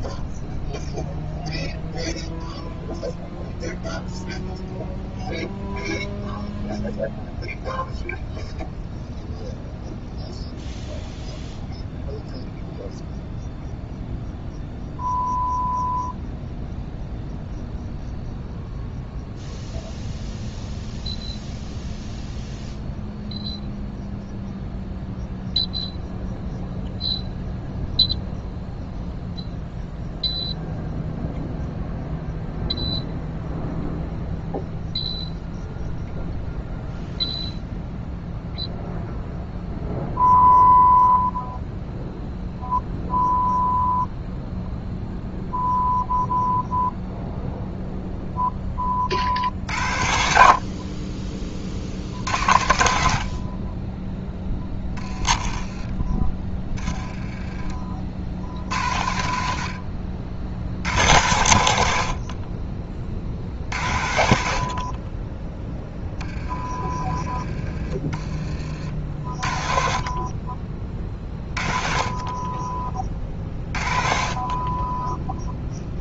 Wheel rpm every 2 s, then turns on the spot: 0, 0, 0, 0, 0, 0, 0, 0, 0, 0, 0, 0, 0, 0, 0, 0, 0, 0, 0, 0, 0, 0, 0, 0, 10, 40, 90, 10, 10, 60, 70, 40, 60, 20, 30, 30, 30, 30.
none